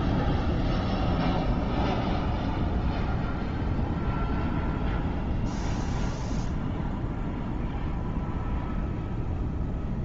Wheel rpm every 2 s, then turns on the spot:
0, 0, 0, 0, 0.
none